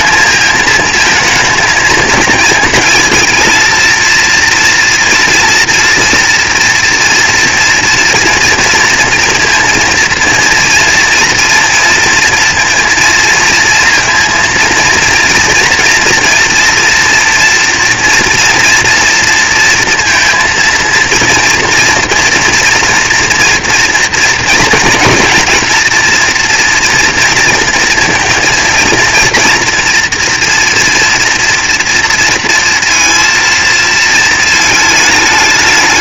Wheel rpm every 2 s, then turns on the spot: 220, 220, 230, 230, 230, 230, 230, 230, 230, 230, 230, 230, 230, 230, 230, 240, 230, 220.
none